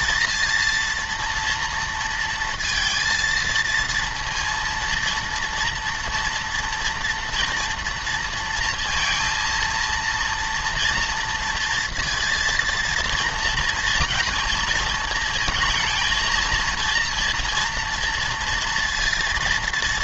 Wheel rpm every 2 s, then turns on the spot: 230, 230, 230, 230, 230, 230, 230, 220, 230, 230.
none